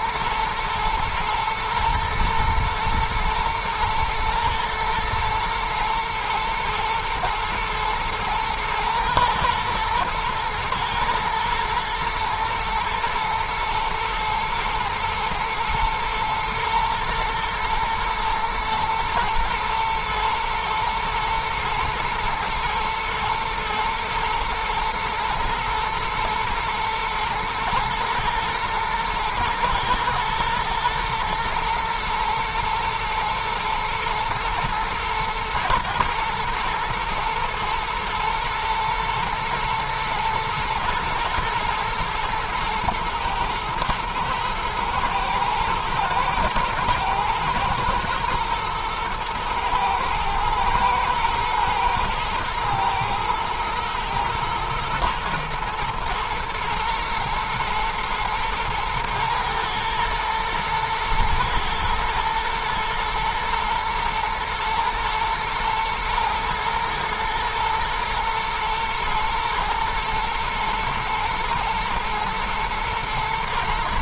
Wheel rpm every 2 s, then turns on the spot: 110, 120, 110, 110, 120, 110, 110, 110, 120, 110, 120, 120, 110, 110, 110, 110, 110, 110, 110, 120, 120, 120, 110, 120, 110, 110, 110, 110, 110, 110, 110, 110, 110, 110, 120, 120, 110.
none